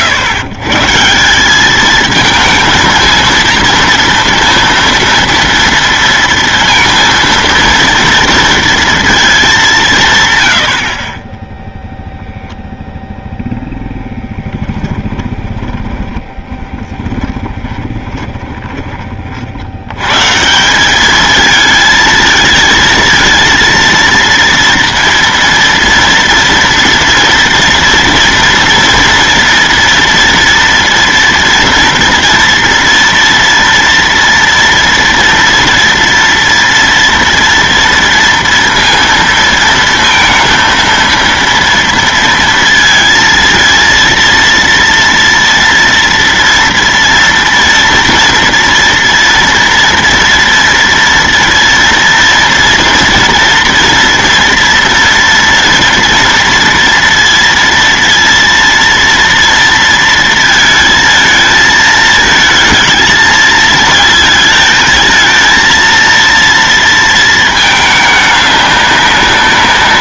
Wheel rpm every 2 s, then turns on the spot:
130, 220, 230, 230, 230, 70, 0, 20, 10, 20, 200, 230, 230, 230, 230, 230, 230, 240, 230, 230, 230, 230, 230, 230, 230, 230, 230, 230, 230, 230, 220, 220, 220, 230, 200.
14-18